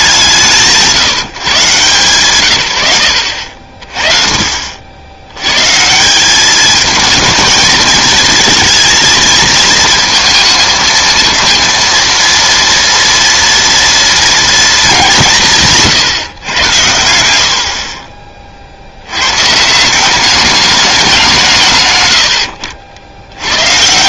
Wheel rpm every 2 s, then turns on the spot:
160, 110, 60, 210, 230, 220, 230, 220, 100, 50, 210, 70.
none